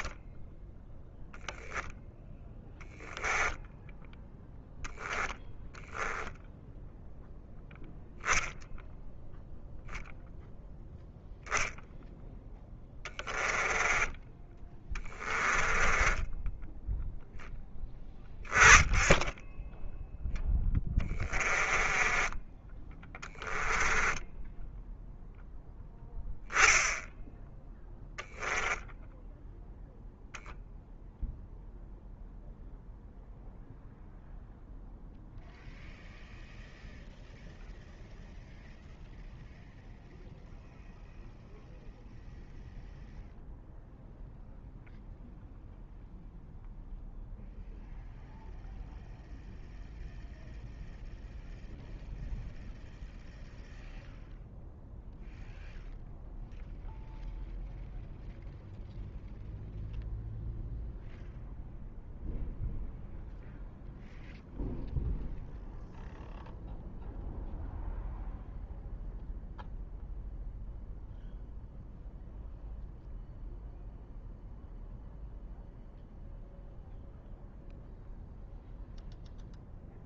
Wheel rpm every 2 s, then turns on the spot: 10, 10, 10, 0, 0, 0, 10, 20, 10, 10, 10, 20, 10, 0, 10, 0, 0, 0, 0, 0, 0, 0, 0, 0, 0, 0, 0, 0, 0, 0, 0, 0, 0, 0, 0, 0, 0, 0, 0, 0.
0-4 12-16 20-22 28-30